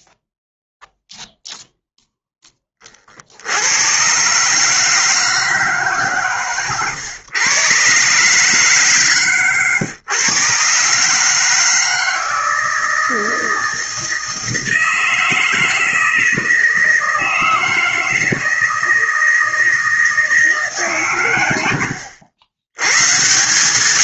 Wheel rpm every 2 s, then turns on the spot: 0, 20, 150, 130, 140, 130, 160, 160, 160, 160, 150, 90.
none